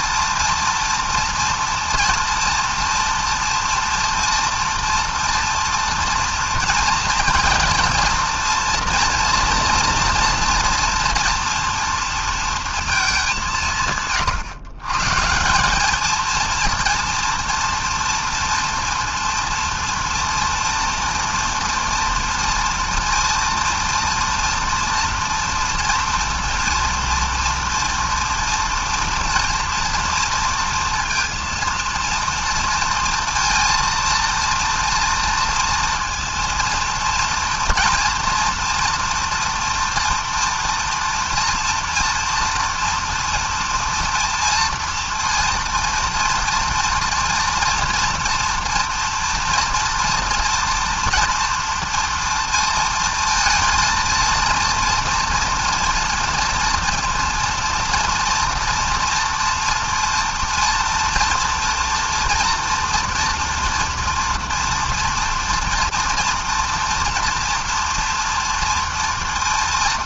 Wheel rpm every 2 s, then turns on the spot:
230, 230, 230, 230, 230, 230, 230, 140, 230, 230, 230, 240, 230, 230, 230, 230, 230, 230, 230, 230, 230, 230, 230, 230, 240, 240, 230, 230, 230, 230, 230, 230, 230, 230, 240.
none